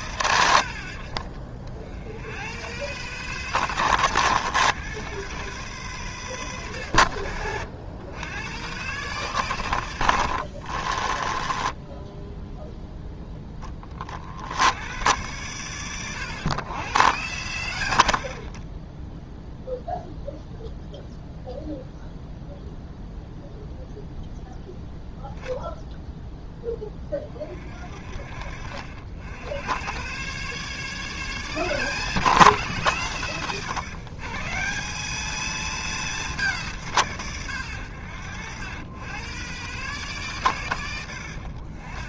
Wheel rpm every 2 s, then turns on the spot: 80, 130, 120, 110, 130, 30, 10, 110, 100, 10, 0, 0, 10, 20, 50, 130, 160, 170, 150, 120, 110.
10-12